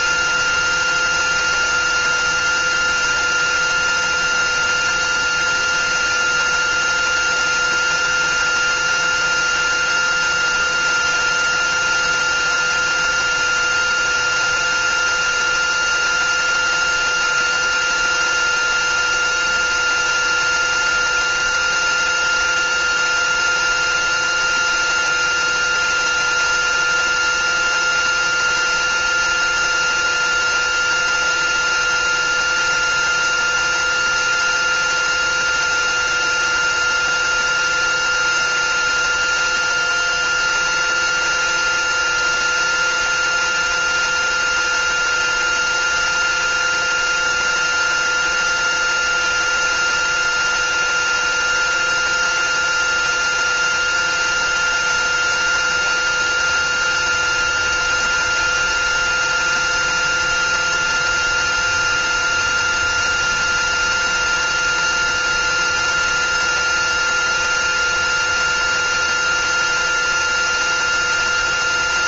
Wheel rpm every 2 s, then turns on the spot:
360, 370, 370, 370, 370, 370, 360, 370, 370, 370, 370, 370, 360, 370, 360, 370, 370, 370, 360, 370, 370, 370, 370, 360, 370, 370, 370, 360, 370, 370, 360, 360, 360, 360, 370, 360.
none